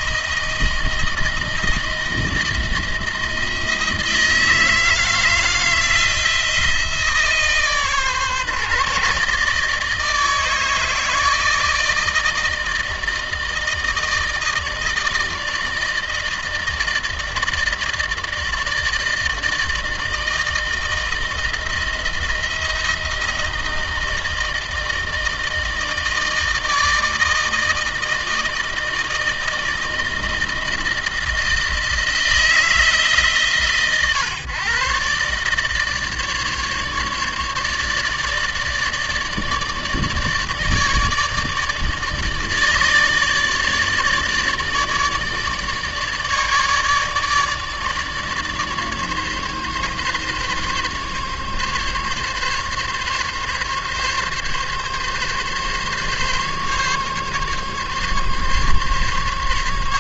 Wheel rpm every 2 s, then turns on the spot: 160, 170, 160, 160, 150, 160, 160, 160, 160, 160, 160, 170, 160, 160, 160, 160, 160, 130, 150, 150, 150, 150, 150, 150, 150, 140, 140, 140, 140, 140.
none